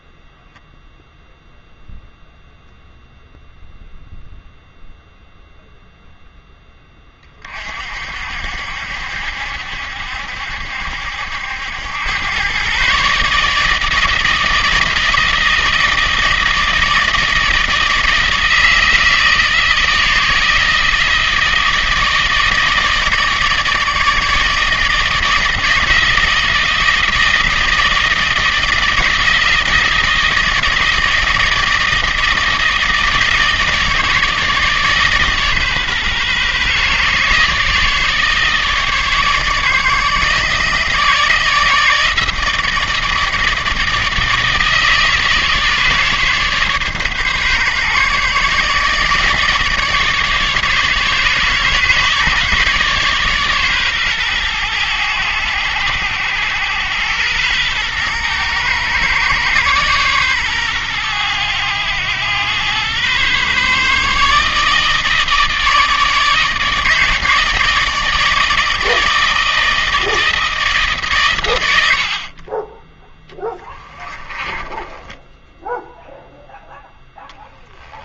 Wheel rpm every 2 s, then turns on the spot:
0, 0, 0, 10, 70, 70, 120, 160, 160, 160, 160, 160, 160, 160, 160, 160, 160, 150, 140, 150, 150, 160, 150, 140, 150, 140, 140, 110, 100, 120, 120, 110, 150, 150, 160, 160, 20, 20, 0.
74-76